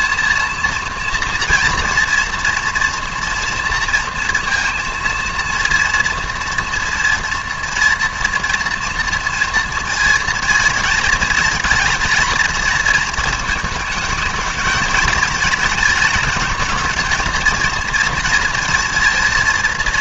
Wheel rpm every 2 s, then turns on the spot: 230, 230, 230, 230, 230, 230, 220, 220, 220, 220.
none